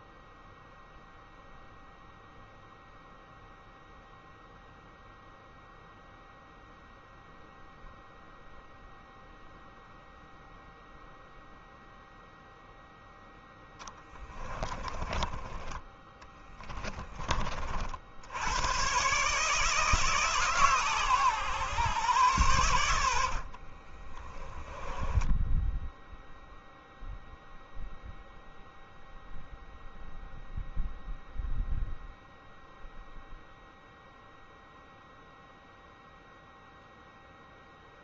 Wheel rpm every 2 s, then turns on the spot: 0, 0, 0, 0, 0, 0, 0, 20, 20, 120, 130, 80, 10, 0, 0, 0, 0, 0, 0.
14-16 22-26